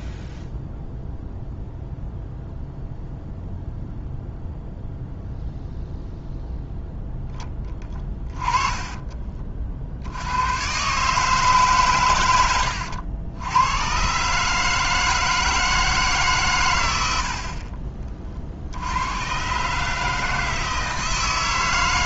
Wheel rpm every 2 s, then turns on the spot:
0, 0, 0, 0, 20, 130, 90, 150, 110, 70, 160.
8-10